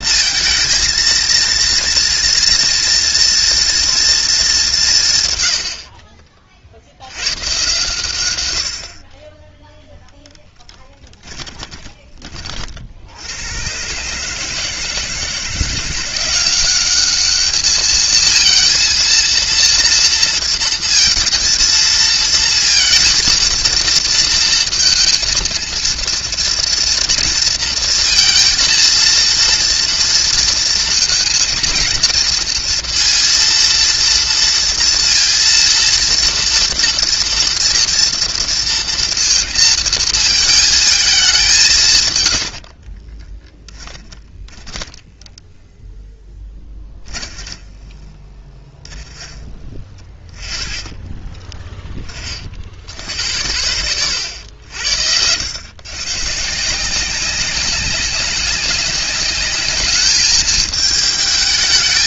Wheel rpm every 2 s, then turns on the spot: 230, 230, 180, 60, 60, 10, 60, 160, 200, 230, 230, 230, 230, 240, 230, 230, 230, 230, 230, 230, 220, 40, 10, 20, 10, 20, 60, 70, 160, 200, 220.
10-12 42-44 46-52